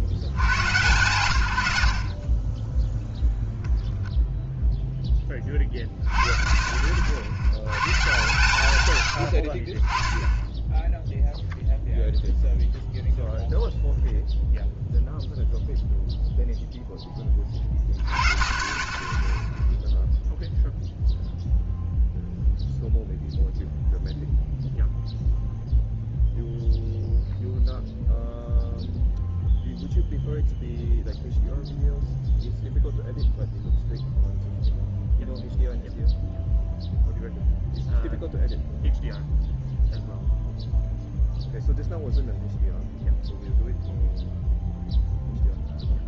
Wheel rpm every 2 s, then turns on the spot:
60, 10, 0, 40, 140, 10, 0, 0, 0, 30, 0, 0, 0, 0, 0, 0, 0, 0, 0, 0, 0, 0, 0.
none